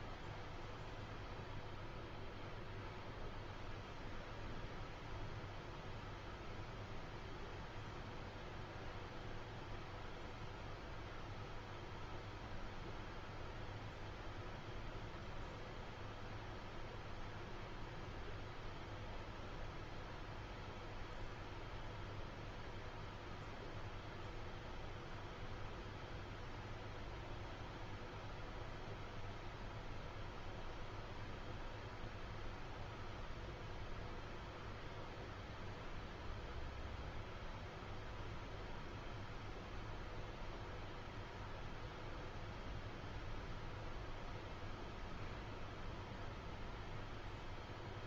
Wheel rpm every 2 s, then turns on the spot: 0, 0, 0, 0, 0, 0, 0, 0, 0, 0, 0, 0, 0, 0, 0, 0, 0, 0, 0, 0, 0, 0, 0, 0.
none